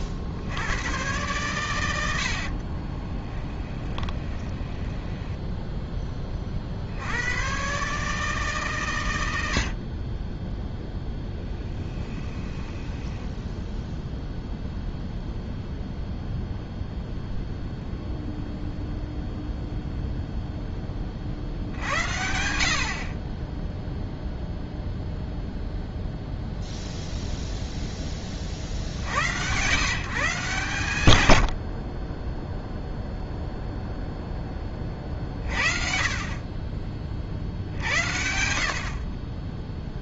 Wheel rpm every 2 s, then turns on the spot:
80, 40, 20, 40, 150, 0, 10, 0, 0, 0, 10, 70, 0, 0, 50, 140, 0, 20, 20, 60.
2-6 12-14